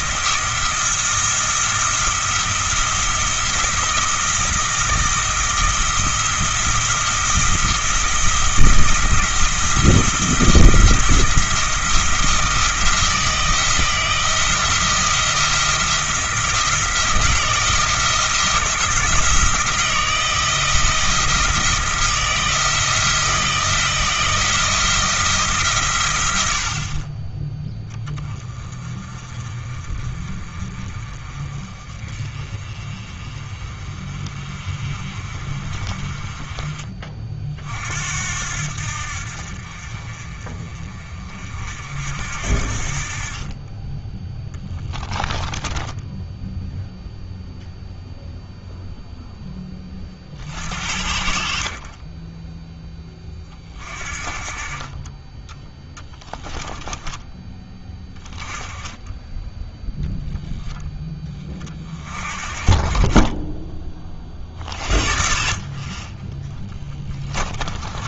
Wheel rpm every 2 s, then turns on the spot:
170, 160, 170, 170, 170, 170, 170, 170, 160, 170, 160, 160, 160, 70, 30, 40, 40, 40, 30, 70, 40, 60, 10, 0, 0, 60, 10, 30, 10, 20, 0, 30, 50, 10.
44-46 56-58 66-68